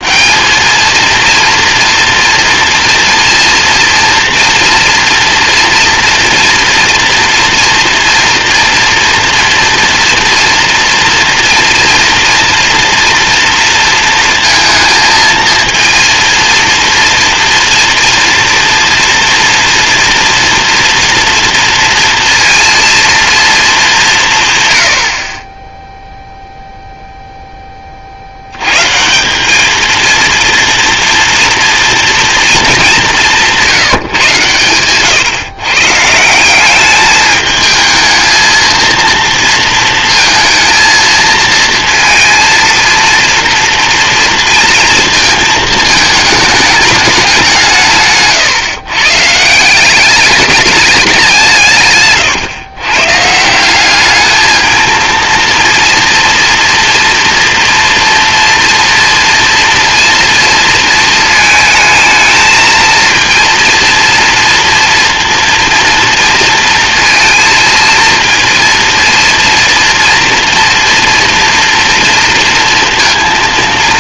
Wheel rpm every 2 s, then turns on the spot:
220, 230, 230, 240, 240, 230, 240, 230, 230, 240, 230, 230, 90, 0, 150, 230, 200, 120, 210, 230, 220, 230, 230, 210, 140, 200, 140, 230, 240, 240, 230, 230, 230, 230, 230, 230, 230.
none